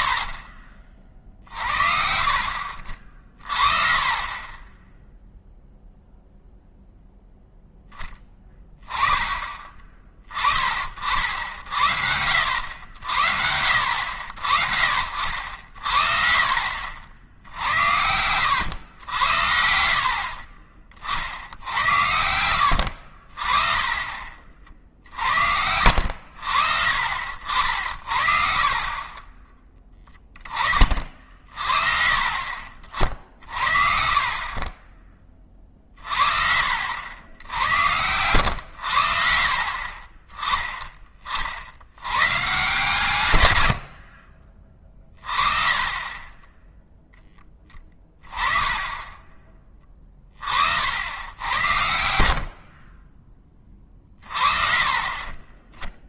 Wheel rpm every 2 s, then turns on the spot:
40, 60, 20, 0, 10, 40, 80, 60, 50, 90, 40, 80, 40, 60, 50, 40, 40, 30, 50, 100, 10, 130, 30, 10, 20, 50, 50, 40.
16-18 22-26 34-36 46-50 54-56